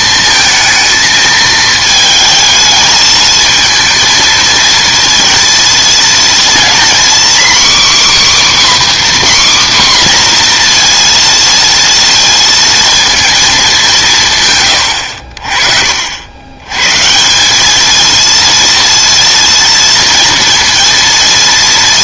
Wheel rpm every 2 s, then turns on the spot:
220, 220, 230, 240, 290, 240, 230, 120, 110, 230, 230.
none